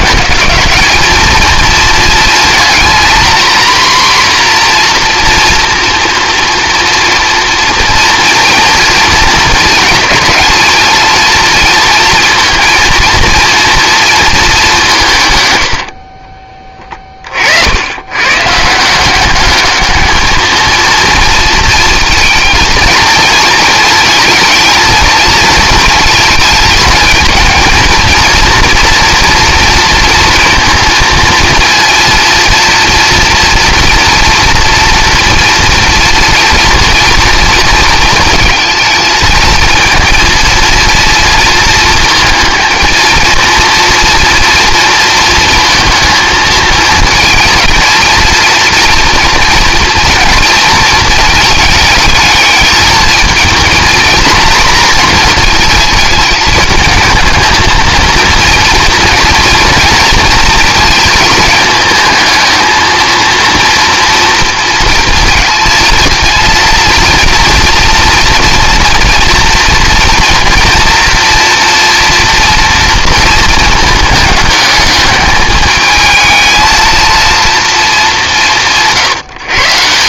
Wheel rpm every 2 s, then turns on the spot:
210, 240, 250, 230, 230, 230, 230, 190, 20, 160, 220, 230, 220, 220, 230, 230, 240, 230, 230, 220, 230, 220, 230, 220, 240, 230, 220, 240, 220, 230, 230, 230, 230, 230, 240, 240, 230, 210, 220, 160.
none